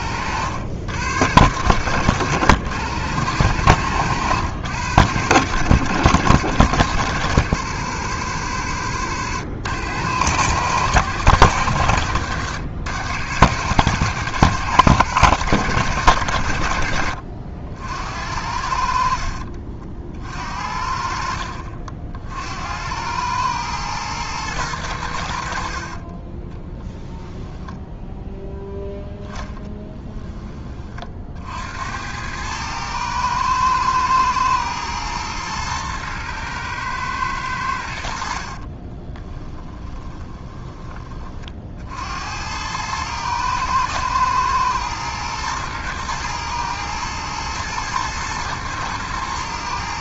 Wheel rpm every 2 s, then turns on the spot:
90, 110, 110, 120, 110, 110, 100, 140, 60, 70, 60, 80, 110, 20, 0, 20, 110, 110, 110, 50, 20, 90, 110, 110, 110.
38-40